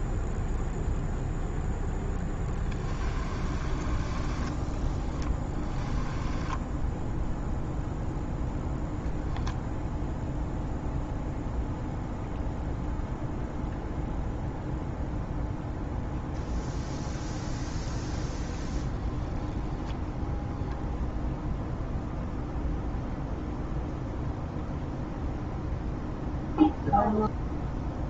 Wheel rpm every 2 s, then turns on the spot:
0, 10, 10, 10, 0, 0, 0, 0, 0, 0, 0, 0, 0, 0.
2-8